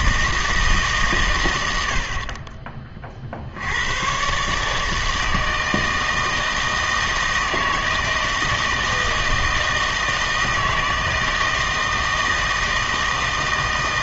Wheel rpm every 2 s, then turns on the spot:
160, 30, 150, 160, 160, 160, 160.
none